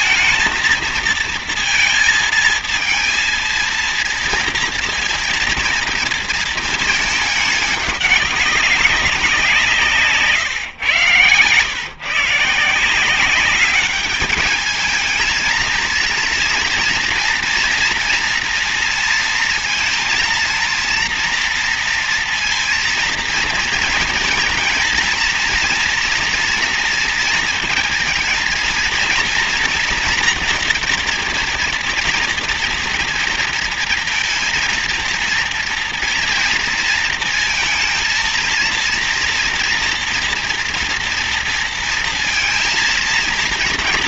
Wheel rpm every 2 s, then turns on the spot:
230, 230, 230, 230, 200, 140, 150, 210, 230, 230, 230, 230, 230, 230, 220, 230, 240, 230, 230, 230, 230, 230.
none